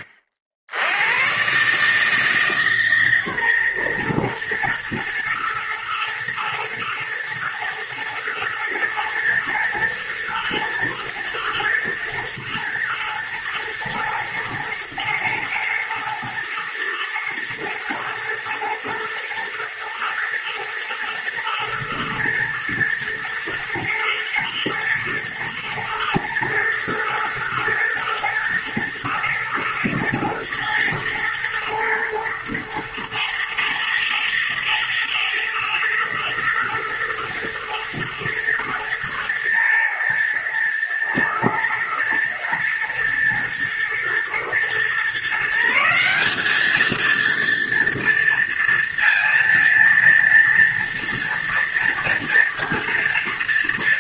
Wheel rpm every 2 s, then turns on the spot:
70, 150, 110, 110, 120, 120, 110, 110, 110, 110, 110, 120, 110, 110, 120, 120, 110, 110, 110, 110, 110, 120, 120, 220, 230, 230, 230.
none